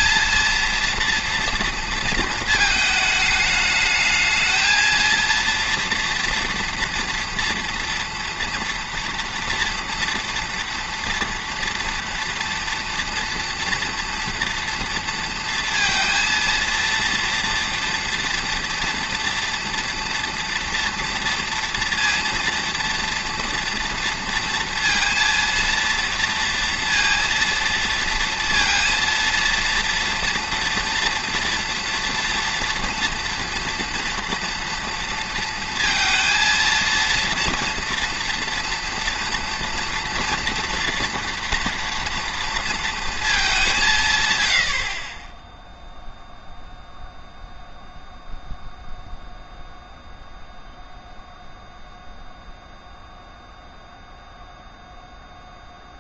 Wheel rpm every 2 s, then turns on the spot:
230, 220, 220, 240, 230, 230, 240, 230, 230, 240, 230, 230, 230, 230, 230, 230, 230, 230, 230, 230, 240, 230, 80, 0, 0, 0, 0, 0.
none